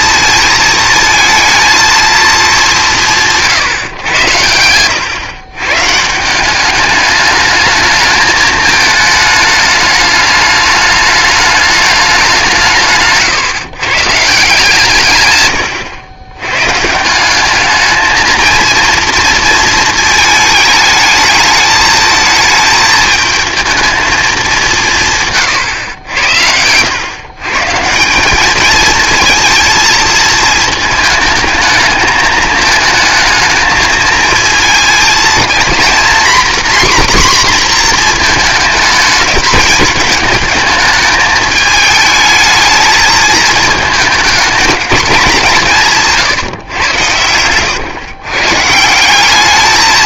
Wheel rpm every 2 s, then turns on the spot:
220, 180, 100, 200, 220, 210, 160, 150, 130, 230, 220, 220, 180, 90, 210, 220, 220, 230, 260, 220, 220, 220, 230, 120, 160.
none